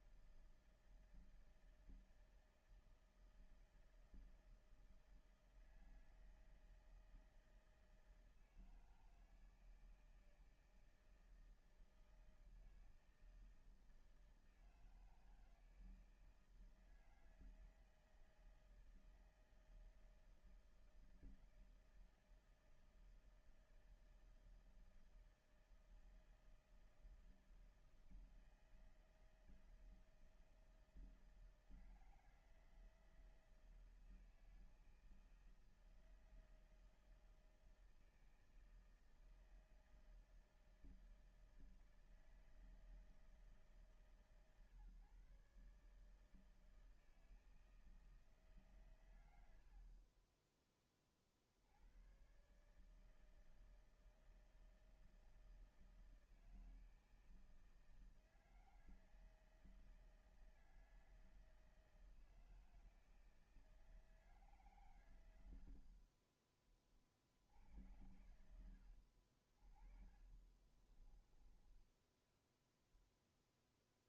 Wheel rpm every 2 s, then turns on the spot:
160, 160, 160, 160, 160, 160, 160, 160, 160, 160, 160, 160, 160, 160, 160, 160, 160, 160, 160, 160, 160, 160, 150, 160, 150, 30, 140, 160, 160, 160, 160, 160, 140, 40, 70, 30, 20.
70-72